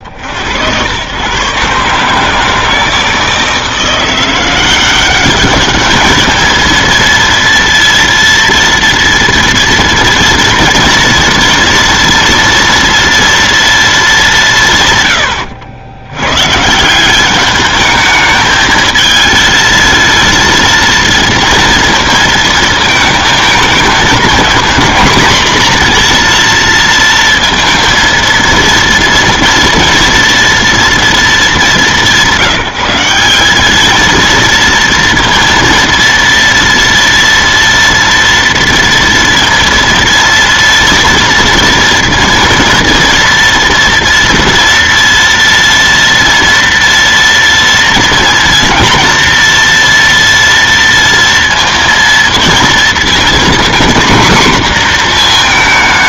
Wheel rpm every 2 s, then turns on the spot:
100, 160, 180, 220, 230, 230, 230, 160, 160, 220, 230, 220, 230, 230, 230, 230, 190, 230, 240, 230, 230, 230, 230, 230, 230, 230, 230, 250.
none